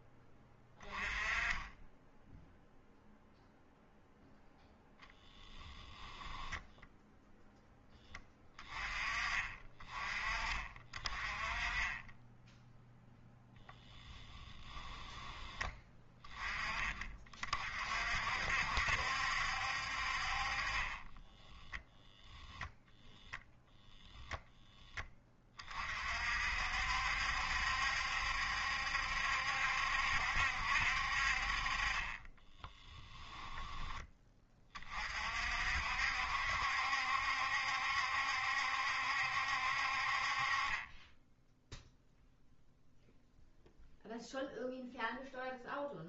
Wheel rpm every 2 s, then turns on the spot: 20, 0, 10, 10, 20, 30, 0, 10, 20, 70, 30, 0, 10, 60, 70, 60, 10, 30, 70, 70, 20, 0, 0.
4-6 14-16 20-22 32-34